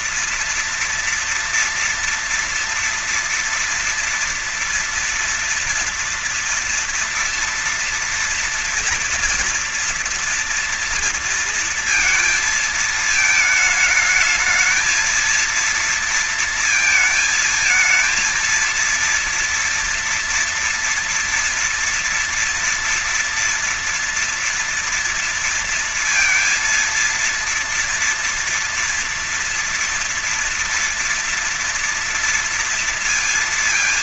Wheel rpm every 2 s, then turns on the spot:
230, 230, 240, 230, 230, 230, 230, 220, 230, 230, 230, 230, 230, 230, 230, 230, 230.
none